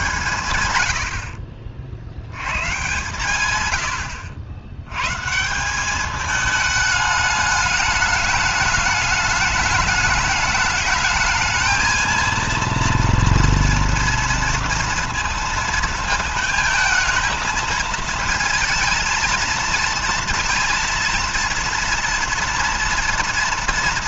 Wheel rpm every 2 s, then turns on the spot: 130, 100, 90, 210, 210, 210, 230, 230, 220, 220, 230, 230.
none